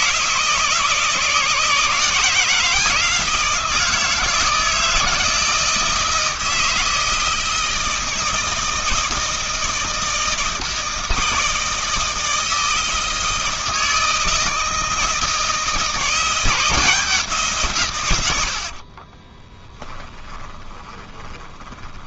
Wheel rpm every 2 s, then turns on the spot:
160, 170, 160, 160, 160, 160, 160, 160, 170, 70, 20.
18-22